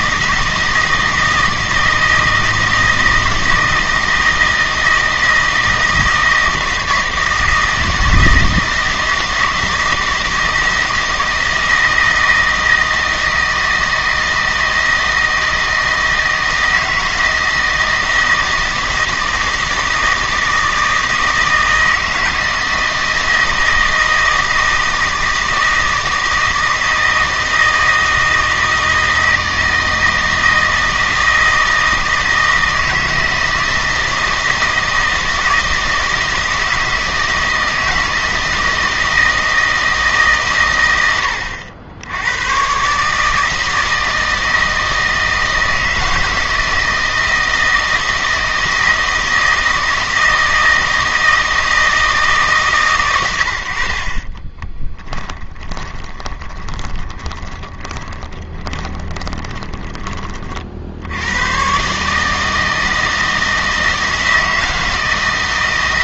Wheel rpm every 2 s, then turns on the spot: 160, 160, 160, 160, 160, 160, 160, 160, 160, 160, 160, 160, 160, 160, 160, 160, 160, 160, 160, 160, 120, 120, 160, 160, 160, 160, 140, 10, 20, 20, 60, 160, 160.
54-60